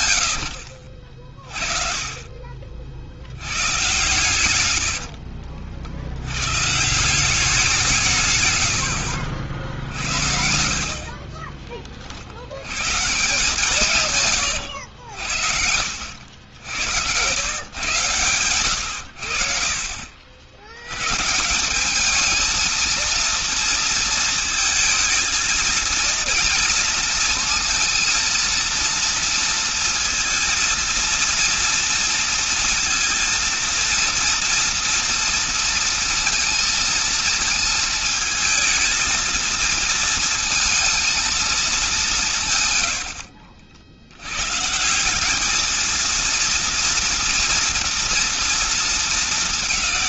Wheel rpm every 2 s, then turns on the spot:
90, 40, 120, 100, 130, 60, 70, 120, 70, 110, 70, 210, 230, 230, 230, 230, 230, 240, 230, 220, 220, 160, 110, 230, 230.
4-6 10-12 14-16 18-20